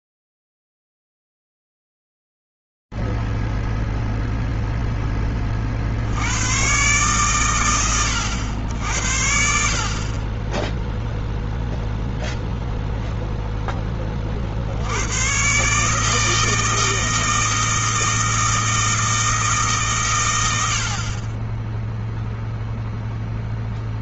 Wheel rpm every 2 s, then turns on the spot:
110, 0, 0, 60, 100, 40, 0, 50, 160, 160, 80, 0.
none